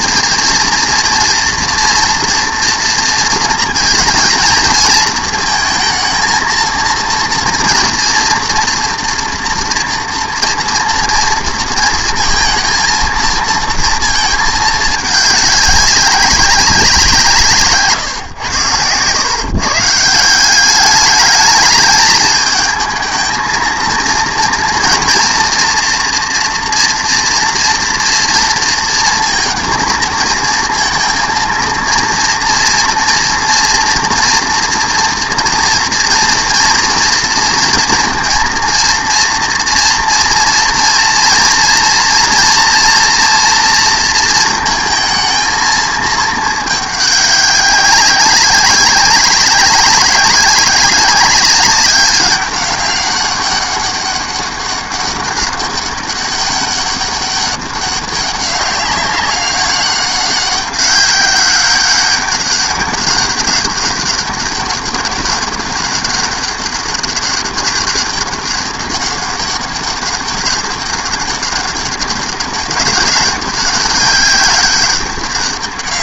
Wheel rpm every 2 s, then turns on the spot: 230, 230, 230, 230, 240, 240, 230, 220, 190, 120, 190, 220, 230, 230, 230, 230, 230, 230, 230, 230, 230, 240, 230, 210, 190, 190, 200, 200, 200, 200, 190, 200, 190, 200, 200, 200, 200, 200.
none